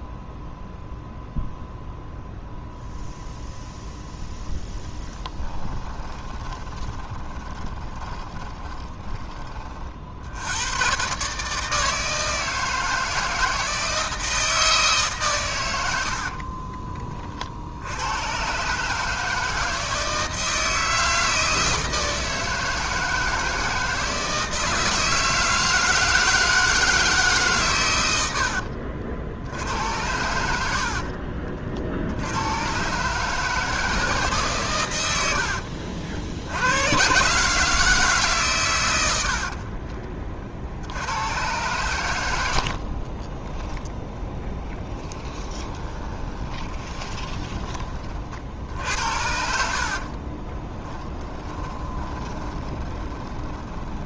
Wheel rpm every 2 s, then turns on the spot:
0, 0, 0, 20, 20, 90, 160, 160, 20, 130, 160, 160, 160, 160, 70, 70, 110, 130, 80, 120, 50, 60, 20, 20, 60, 20, 20.
6-10 16-18 30-32 42-48 50-54